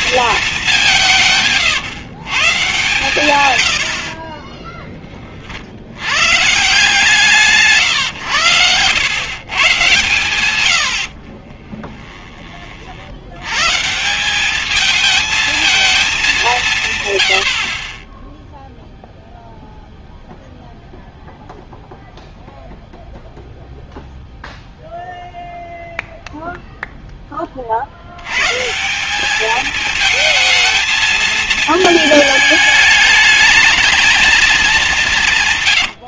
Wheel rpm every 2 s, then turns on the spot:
220, 140, 40, 130, 110, 110, 20, 180, 200, 10, 0, 0, 0, 0, 100, 220, 220, 220.
4-6